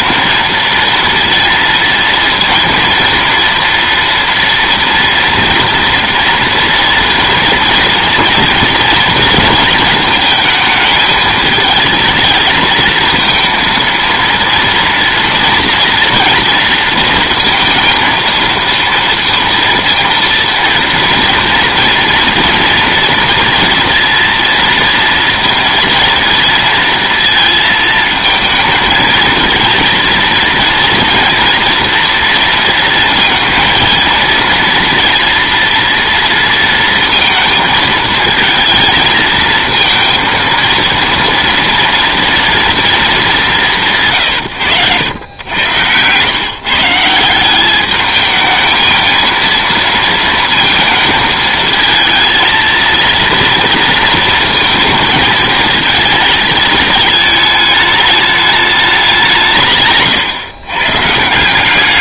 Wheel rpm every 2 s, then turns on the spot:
230, 230, 230, 230, 230, 220, 220, 230, 230, 230, 230, 230, 230, 230, 220, 230, 230, 230, 230, 220, 230, 230, 110, 150, 220, 220, 230, 230, 220, 200, 130.
none